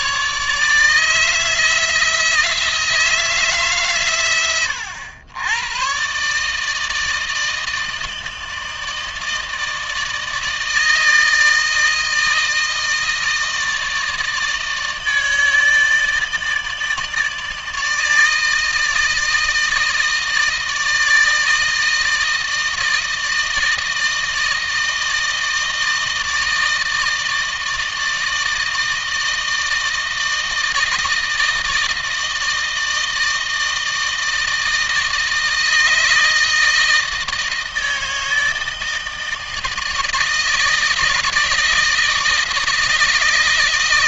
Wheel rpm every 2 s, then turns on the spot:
160, 160, 110, 160, 160, 160, 160, 160, 150, 160, 160, 160, 160, 160, 160, 160, 160, 160, 160, 160, 160, 160.
none